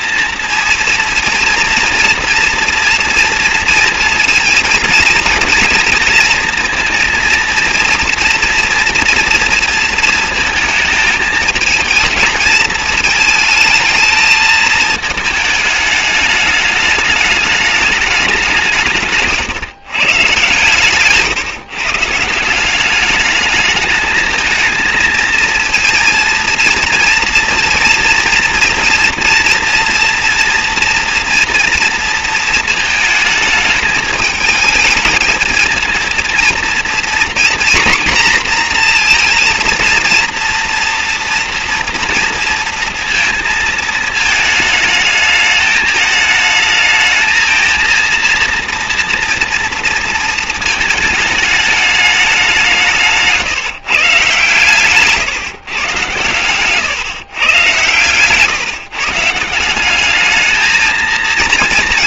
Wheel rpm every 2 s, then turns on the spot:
230, 240, 230, 230, 240, 220, 220, 220, 210, 150, 140, 190, 220, 230, 230, 230, 220, 220, 240, 240, 230, 230, 220, 220, 230, 220, 160, 150, 130, 160, 220.
none